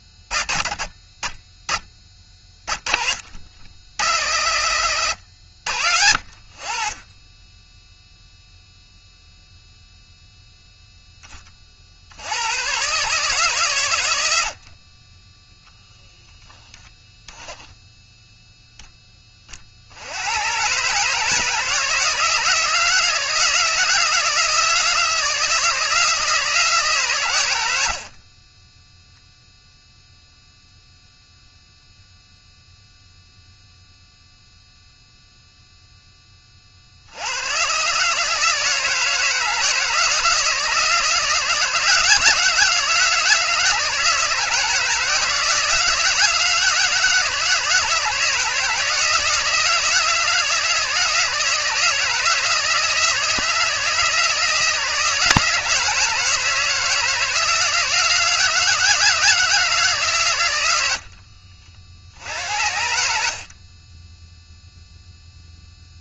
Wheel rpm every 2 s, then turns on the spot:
30, 20, 100, 50, 0, 0, 110, 60, 0, 0, 120, 170, 170, 150, 20, 0, 0, 0, 30, 160, 160, 160, 170, 160, 160, 160, 160, 160, 160, 160, 100, 80, 0.
none